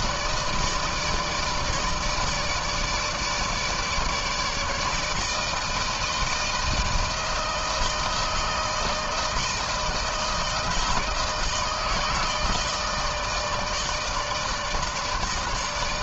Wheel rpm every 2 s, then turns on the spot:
160, 150, 150, 160, 160, 160, 160, 160.
none